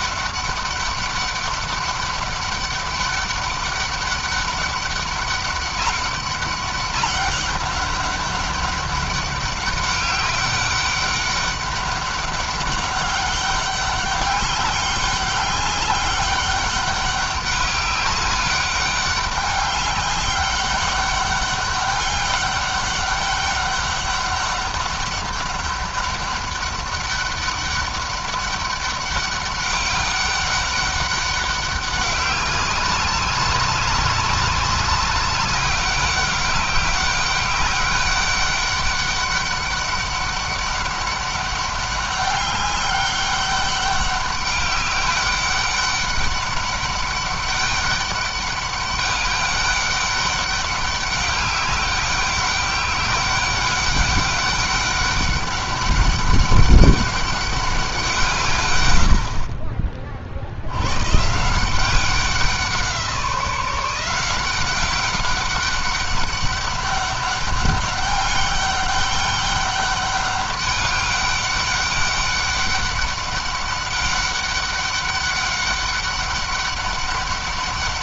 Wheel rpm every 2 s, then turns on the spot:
200, 200, 200, 200, 200, 200, 200, 200, 200, 200, 200, 200, 200, 200, 200, 200, 190, 200, 200, 200, 200, 200, 200, 200, 200, 200, 200, 200, 200, 100, 100, 170, 190, 200, 200, 200, 200, 200, 200.
none